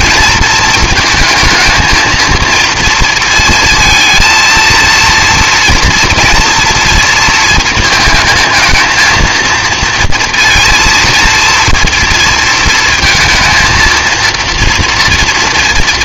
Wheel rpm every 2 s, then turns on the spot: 220, 230, 230, 240, 230, 230, 230, 230.
none